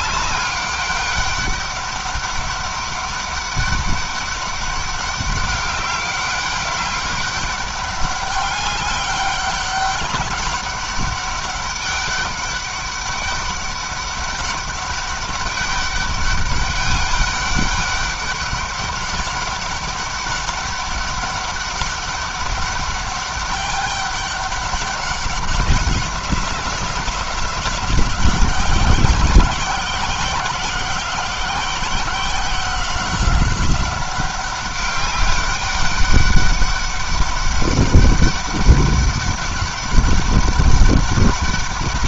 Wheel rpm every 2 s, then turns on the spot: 200, 190, 200, 200, 200, 190, 200, 200, 200, 200, 200, 200, 190, 180, 180, 180, 180, 190, 200, 200, 200.
none